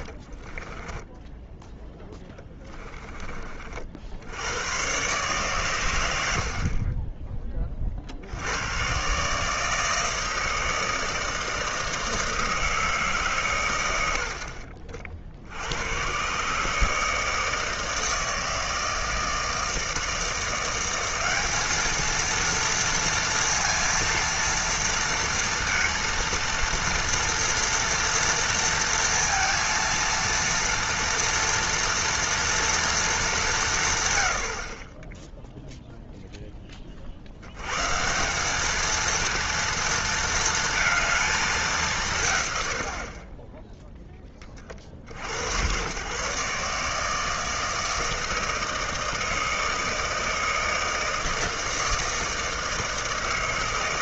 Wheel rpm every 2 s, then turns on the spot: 20, 10, 100, 50, 100, 160, 160, 60, 150, 160, 170, 230, 230, 230, 230, 230, 230, 70, 20, 210, 230, 90, 30, 140, 160, 160, 160.
0-4